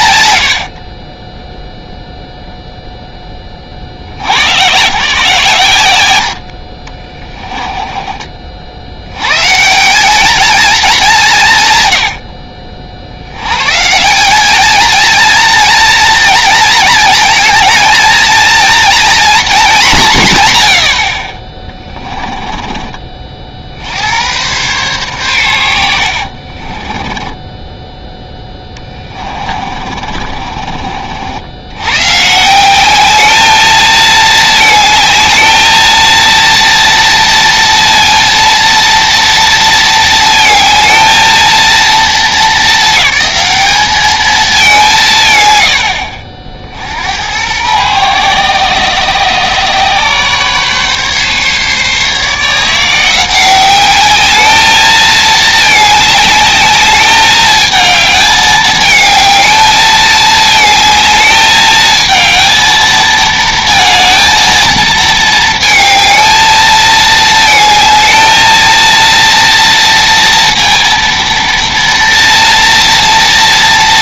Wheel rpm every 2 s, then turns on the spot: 90, 0, 110, 60, 40, 210, 80, 200, 220, 230, 130, 20, 100, 50, 20, 40, 160, 220, 230, 230, 220, 220, 200, 60, 120, 140, 160, 210, 210, 220, 220, 220, 220, 220, 230, 230, 230.
26-32